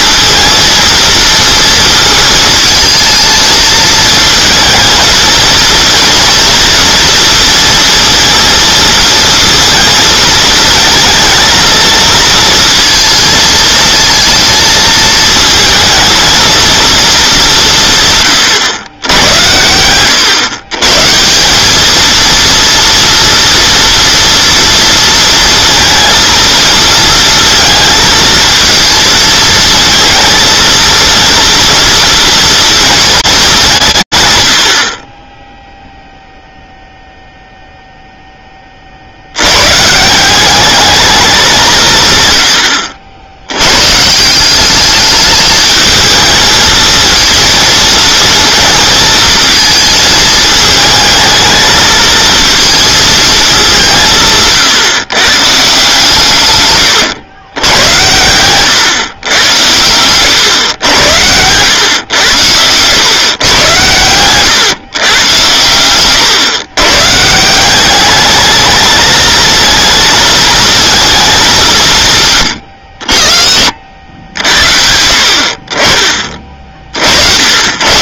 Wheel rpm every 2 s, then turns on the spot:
230, 220, 220, 230, 230, 230, 230, 230, 230, 100, 130, 230, 230, 230, 230, 230, 230, 100, 0, 30, 200, 100, 190, 230, 220, 220, 230, 150, 130, 120, 100, 110, 130, 120, 220, 230, 80, 70, 50.
none